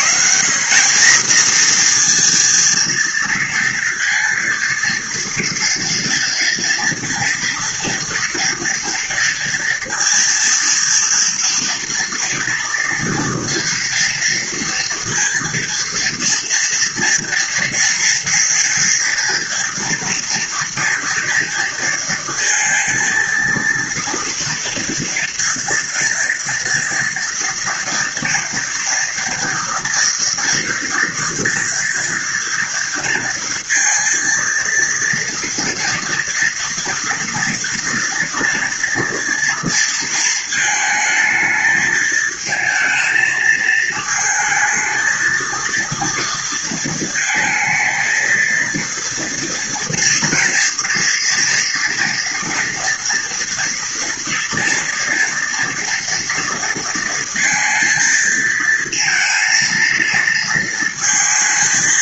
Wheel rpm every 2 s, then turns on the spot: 200, 230, 230, 230, 230, 230, 230, 230, 240, 240, 230, 230, 230, 230, 230, 230, 230, 230, 230, 230, 230, 220, 220, 230, 230, 230, 230, 240, 230, 230, 230.
none